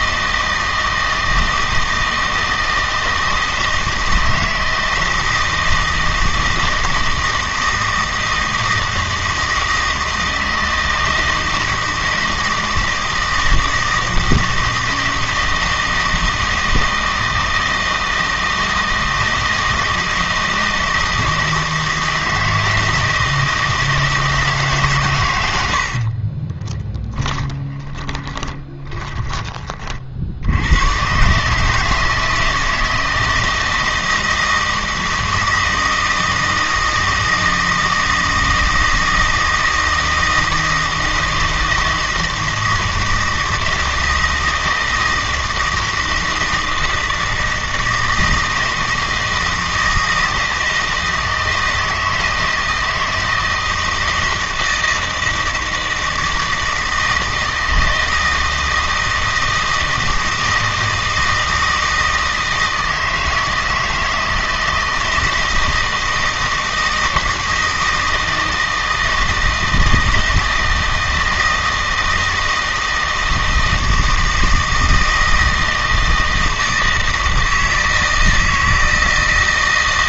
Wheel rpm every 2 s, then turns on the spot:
160, 160, 160, 160, 160, 160, 160, 160, 160, 160, 160, 160, 140, 10, 20, 100, 160, 160, 160, 160, 160, 160, 160, 160, 160, 160, 160, 160, 160, 160, 160, 160, 160, 160, 160, 160, 160, 160, 160, 160.
26-30